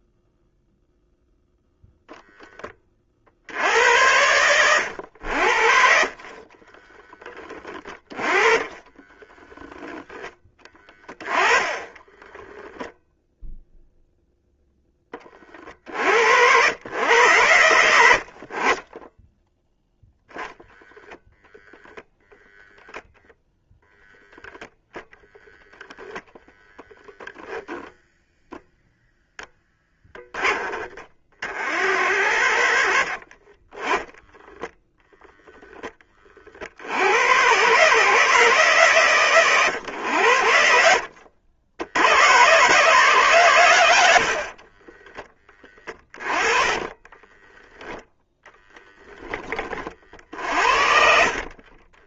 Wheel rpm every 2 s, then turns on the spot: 0, 20, 100, 20, 20, 20, 0, 20, 100, 20, 0, 10, 0, 0, 0, 20, 60, 0, 90, 140, 70, 130, 30, 20, 10, 60.
6-10 22-24 44-48 50-52